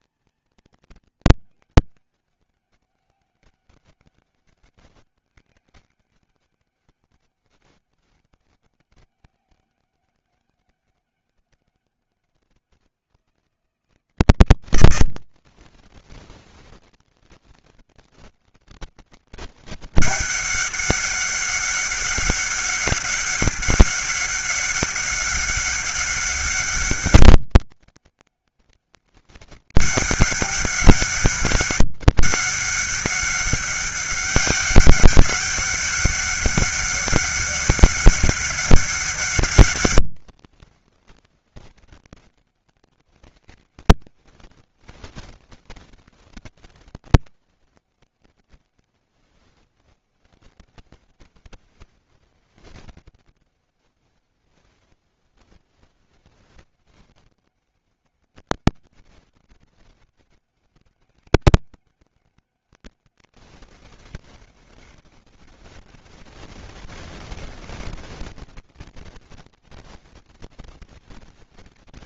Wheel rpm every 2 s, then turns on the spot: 230, 200, 200, 200, 200, 200, 190, 170, 190, 200, 200, 200, 200, 200, 200, 200, 200, 200, 200, 200, 200, 200, 200, 200, 200, 200, 200, 200, 200, 200, 190, 200, 200, 190, 200, 200.
none